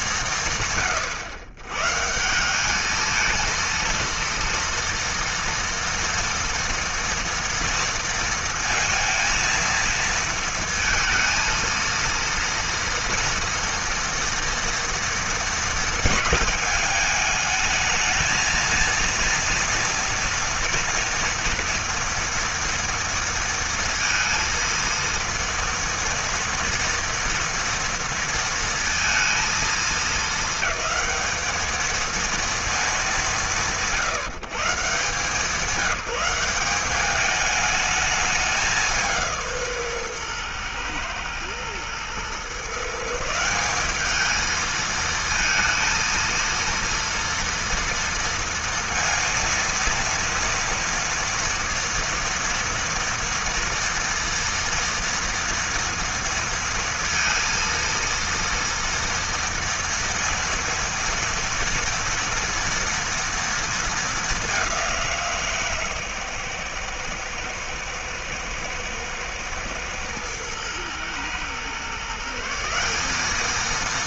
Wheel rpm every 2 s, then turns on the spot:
120, 230, 230, 230, 230, 230, 240, 230, 220, 230, 230, 230, 230, 230, 220, 220, 170, 190, 210, 150, 120, 170, 230, 240, 230, 240, 230, 230, 230, 230, 230, 230, 160, 120, 110, 120, 200.
none